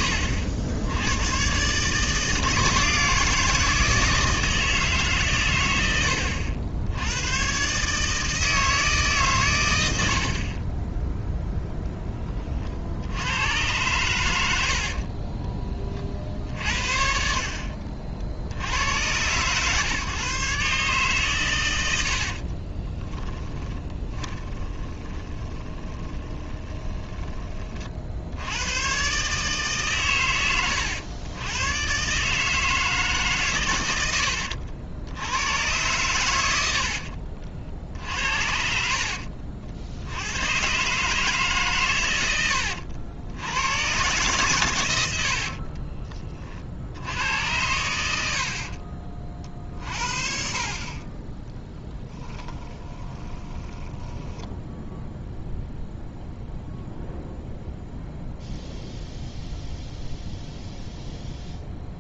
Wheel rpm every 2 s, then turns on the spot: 90, 160, 150, 90, 150, 10, 60, 50, 60, 100, 140, 20, 30, 30, 110, 100, 160, 80, 70, 60, 130, 80, 90, 60, 50, 40, 10, 10, 0, 0, 0.
22-28 36-38 52-56